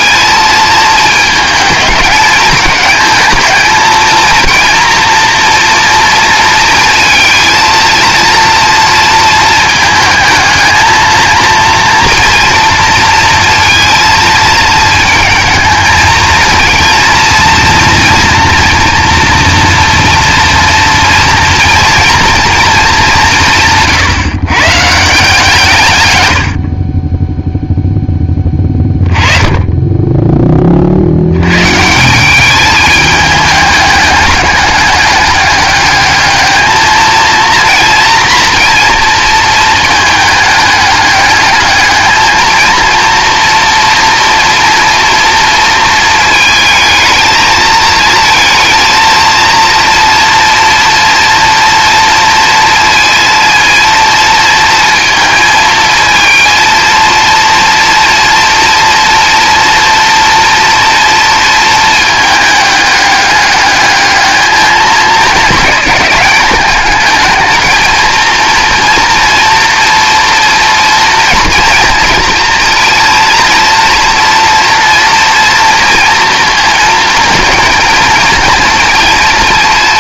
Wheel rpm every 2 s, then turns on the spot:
220, 220, 230, 230, 230, 220, 230, 220, 230, 230, 230, 220, 150, 40, 20, 40, 210, 200, 220, 230, 210, 220, 230, 220, 230, 230, 230, 230, 220, 240, 230, 210, 210, 220, 240, 240, 230, 230, 230, 230.
none